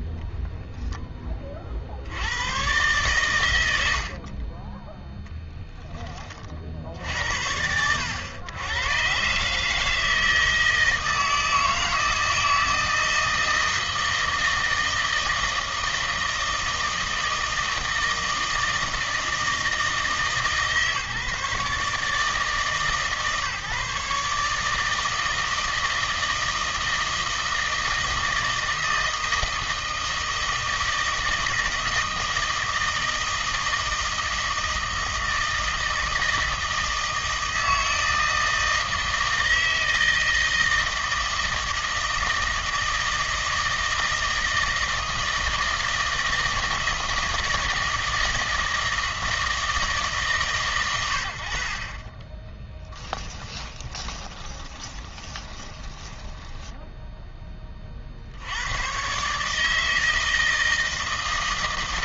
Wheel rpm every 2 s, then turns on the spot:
10, 120, 20, 60, 110, 160, 160, 160, 160, 160, 150, 150, 150, 160, 160, 160, 160, 160, 160, 160, 160, 160, 160, 160, 160, 120, 10, 20, 10, 90, 160.
52-58